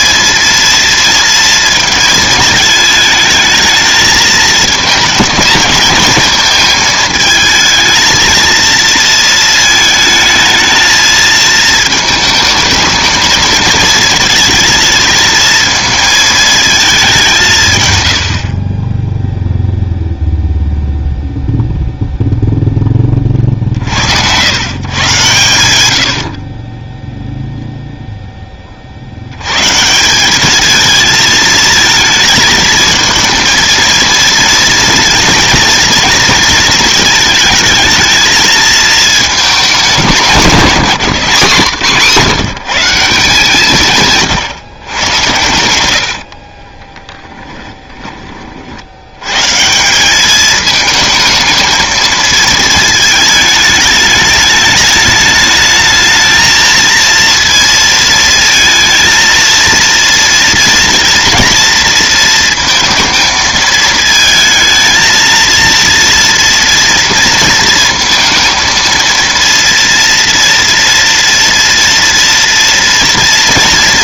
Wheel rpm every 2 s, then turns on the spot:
230, 220, 220, 220, 230, 220, 220, 230, 220, 40, 0, 0, 110, 30, 40, 220, 220, 230, 230, 220, 190, 170, 110, 30, 50, 220, 220, 210, 220, 230, 230, 230, 220, 230, 230, 230, 230.
46-48